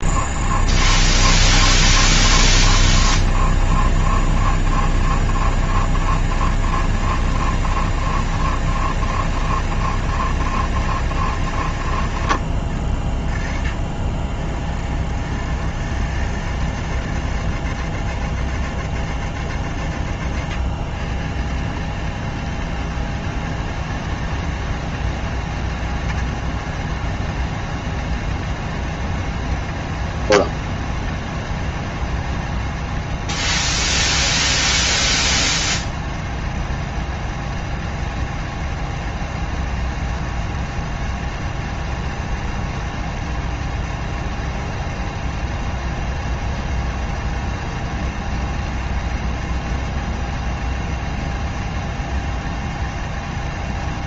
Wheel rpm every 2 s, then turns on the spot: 160, 160, 160, 160, 170, 160, 50, 80, 150, 160, 120, 160, 160, 160, 170, 170, 170, 170, 170, 170, 170, 170, 170, 170, 170, 170, 160.
none